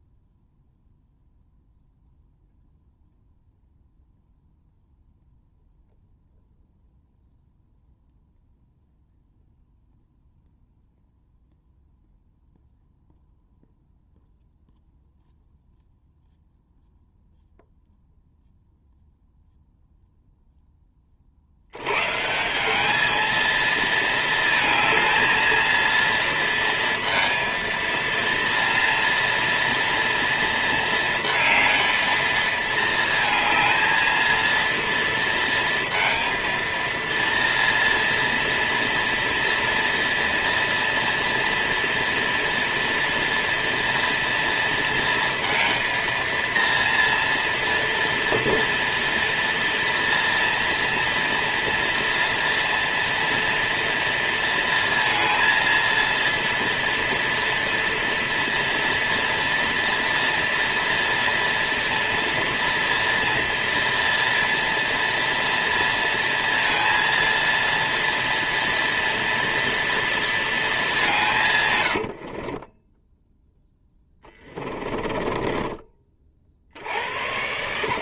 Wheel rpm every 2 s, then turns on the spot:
0, 0, 0, 0, 0, 0, 0, 0, 0, 0, 30, 210, 220, 230, 230, 230, 220, 230, 230, 230, 230, 230, 230, 230, 230, 230, 230, 230, 230, 230, 230, 230, 230, 230, 230, 200, 20, 20, 60.
72-76